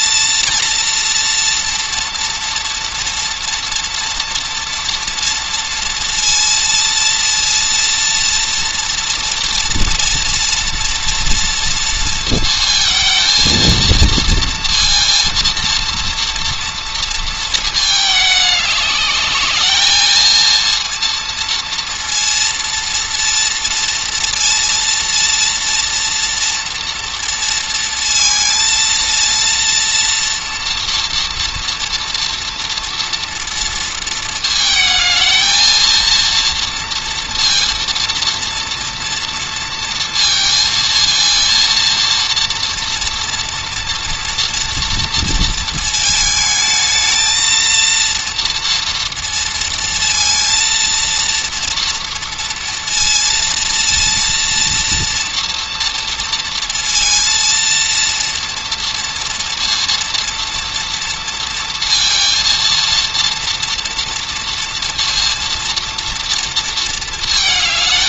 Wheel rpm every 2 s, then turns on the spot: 230, 230, 230, 230, 240, 230, 230, 230, 230, 210, 230, 230, 230, 230, 230, 230, 230, 220, 230, 230, 230, 230, 230, 220, 230, 230, 230, 230, 230, 230, 230, 230, 230, 230.
none